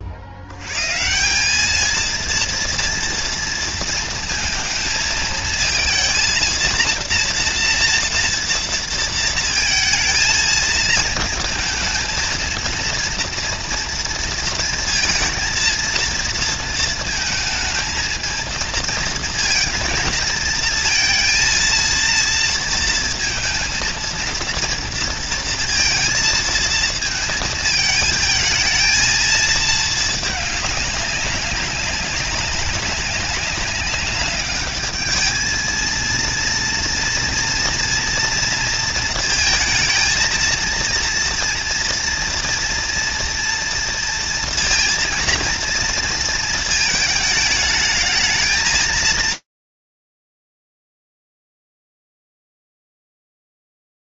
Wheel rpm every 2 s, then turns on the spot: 140, 230, 230, 230, 230, 220, 230, 230, 230, 220, 230, 230, 230, 230, 220, 200, 200, 210, 230, 230, 230, 230, 230, 220, 220, 80, 0.
none